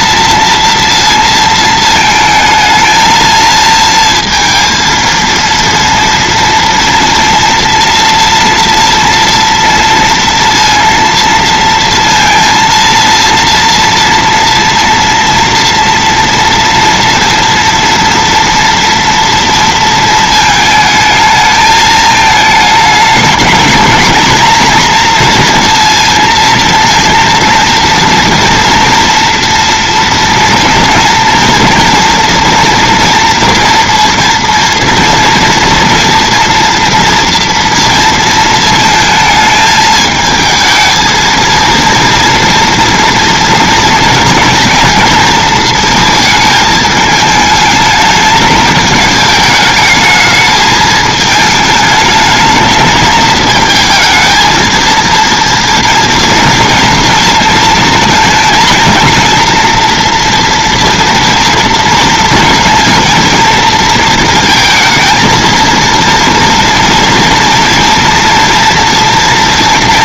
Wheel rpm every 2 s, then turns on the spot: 230, 220, 230, 230, 240, 230, 230, 230, 230, 230, 220, 220, 240, 230, 230, 230, 230, 230, 230, 230, 220, 230, 230, 220, 210, 220, 220, 220, 230, 230, 230, 220, 220, 230, 230.
none